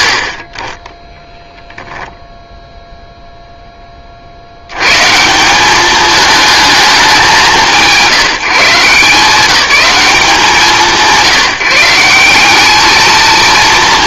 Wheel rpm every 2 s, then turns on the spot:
50, 0, 110, 190, 160, 160, 210.
none